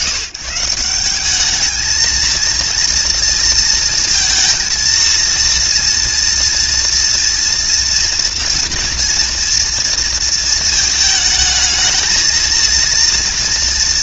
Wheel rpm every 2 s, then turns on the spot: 170, 230, 230, 230, 230, 230, 230.
none